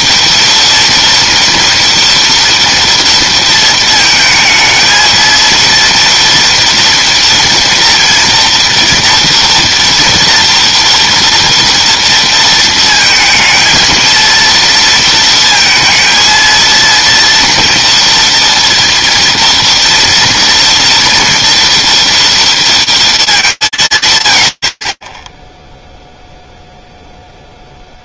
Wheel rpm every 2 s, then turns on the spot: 230, 230, 220, 230, 230, 230, 230, 230, 230, 230, 230, 230, 70, 0.
none